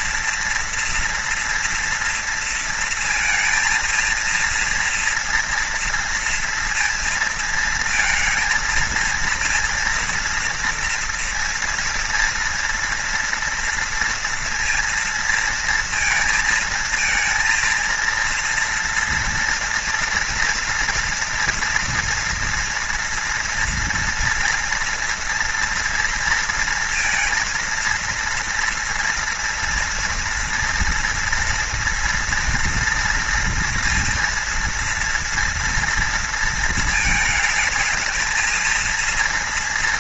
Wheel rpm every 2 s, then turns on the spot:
240, 230, 230, 230, 230, 230, 230, 230, 230, 230, 230, 230, 240, 230, 230, 230, 230, 230, 230, 220.
none